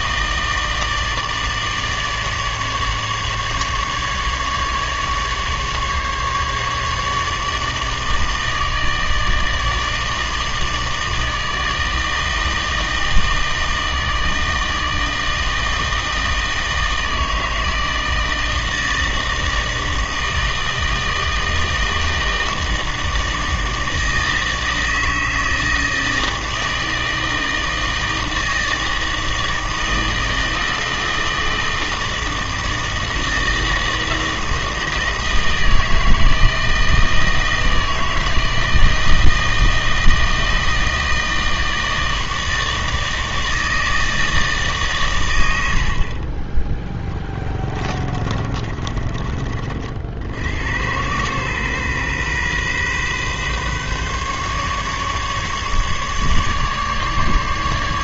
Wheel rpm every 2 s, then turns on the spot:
160, 150, 150, 140, 160, 160, 160, 160, 160, 160, 160, 160, 160, 160, 160, 160, 160, 160, 160, 160, 160, 160, 150, 10, 30, 80, 130, 140, 150.
48-50